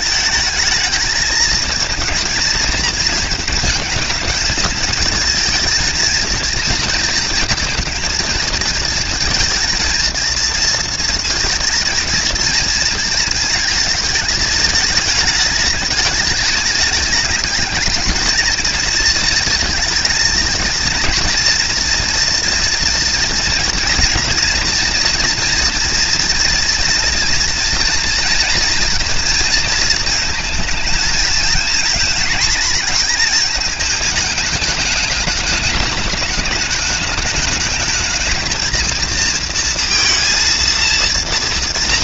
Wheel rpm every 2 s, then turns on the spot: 220, 220, 230, 230, 230, 230, 230, 210, 210, 230, 240, 230, 230, 230, 230, 230, 230, 210, 220, 230, 240.
none